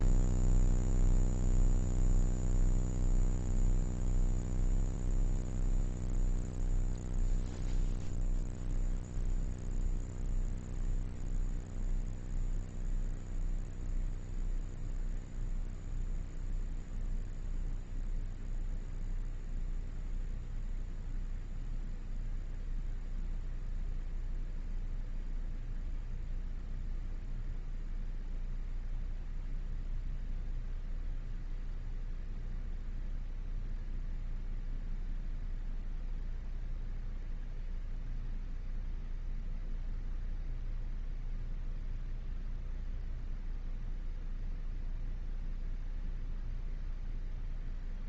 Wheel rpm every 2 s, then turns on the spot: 0, 0, 0, 0, 0, 0, 0, 0, 0, 0, 0, 0, 0, 0, 0, 0, 0, 0, 0, 0, 0, 0, 0, 0.
none